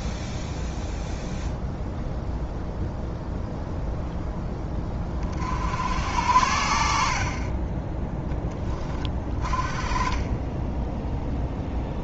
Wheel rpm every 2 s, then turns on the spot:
0, 0, 20, 60, 30, 10.
none